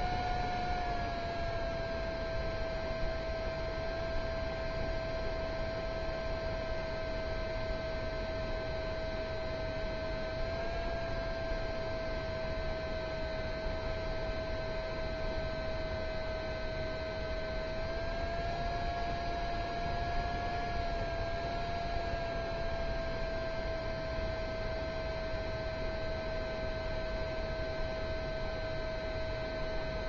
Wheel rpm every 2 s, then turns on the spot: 0, 0, 0, 0, 0, 0, 0, 0, 0, 0, 0, 0, 0, 0, 0.
none